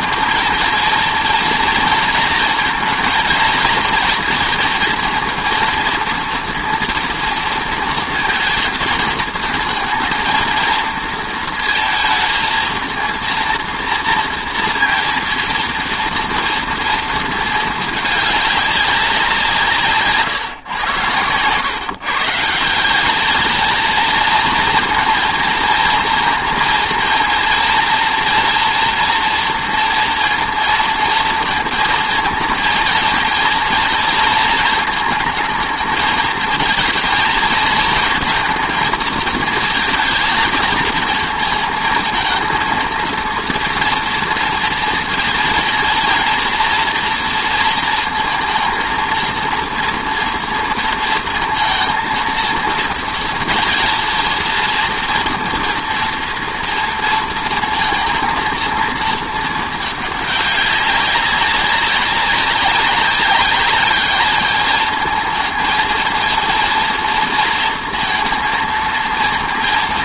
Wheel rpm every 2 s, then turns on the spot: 230, 230, 230, 230, 230, 230, 220, 230, 230, 200, 120, 170, 230, 230, 240, 230, 220, 220, 220, 220, 220, 230, 230, 230, 230, 230, 230, 230, 230, 230, 200, 200, 220, 230, 230.
none